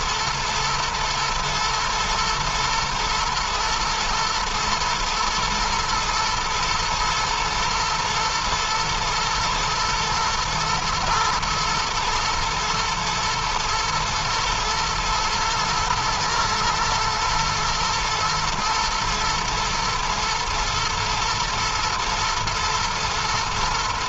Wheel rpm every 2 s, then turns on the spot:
120, 110, 120, 120, 120, 110, 120, 110, 120, 120, 110, 110.
none